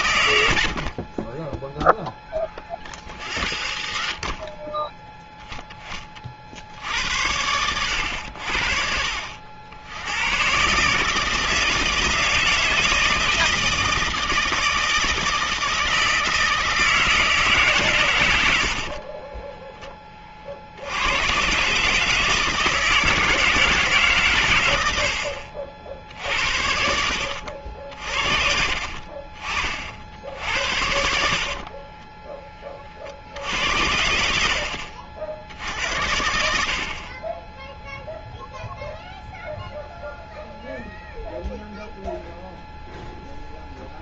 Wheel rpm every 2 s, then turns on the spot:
80, 40, 20, 60, 70, 130, 160, 160, 160, 80, 50, 160, 110, 60, 50, 80, 20, 70, 70, 0, 0, 0.
none